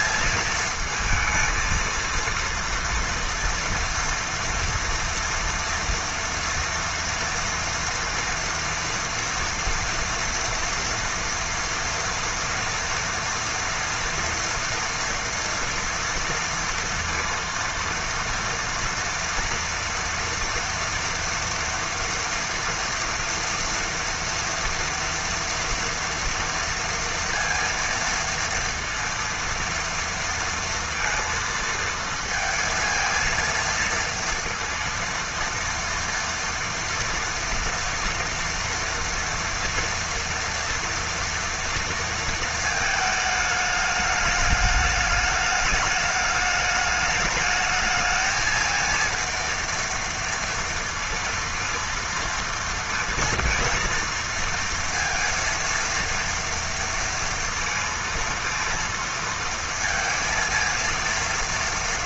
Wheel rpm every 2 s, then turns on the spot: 220, 230, 230, 230, 230, 230, 230, 230, 230, 230, 230, 230, 230, 230, 230, 230, 230, 230, 230, 240, 230, 230, 210, 210, 220, 230, 230, 230, 230, 230, 230.
none